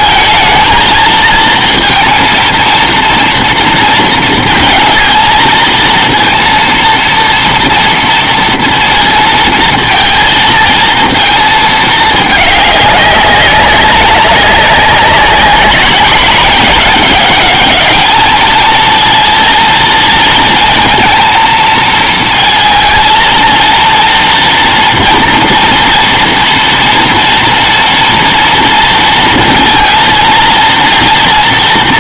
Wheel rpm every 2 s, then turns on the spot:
220, 230, 230, 230, 230, 230, 210, 190, 200, 220, 230, 230, 230, 230, 230, 230.
none